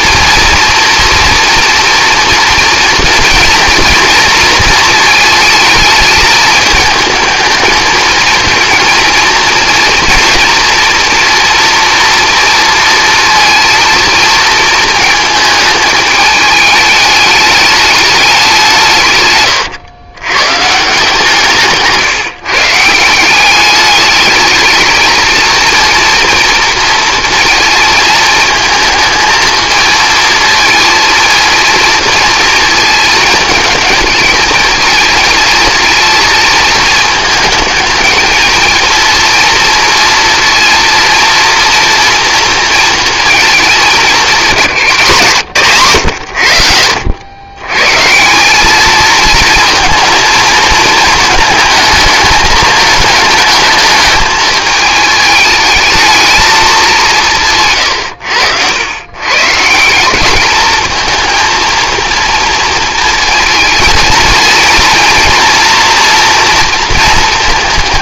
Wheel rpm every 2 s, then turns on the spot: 230, 230, 230, 220, 230, 240, 230, 220, 210, 180, 140, 150, 220, 230, 230, 230, 230, 220, 220, 230, 230, 230, 180, 90, 200, 230, 220, 220, 220, 100, 220, 230, 230, 230.
none